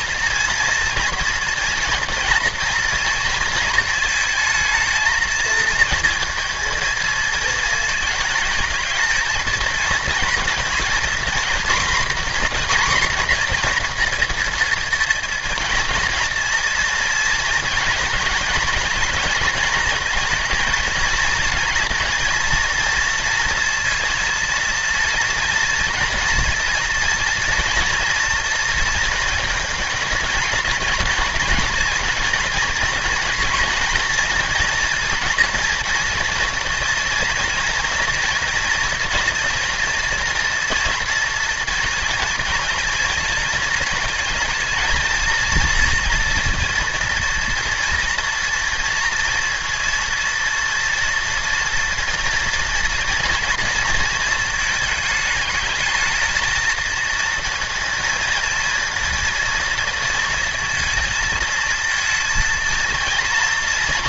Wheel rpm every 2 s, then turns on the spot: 230, 230, 230, 230, 230, 230, 250, 230, 230, 230, 230, 230, 230, 230, 230, 230, 230, 230, 230, 230, 230, 220, 230, 230, 230, 230, 240, 220, 230, 230, 230, 230.
none